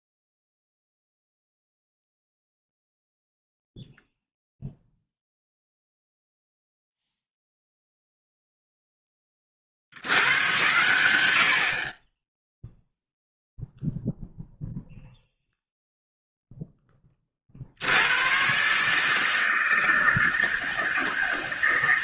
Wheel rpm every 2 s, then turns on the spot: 0, 0, 0, 0, 0, 100, 0, 0, 10, 130, 160.
none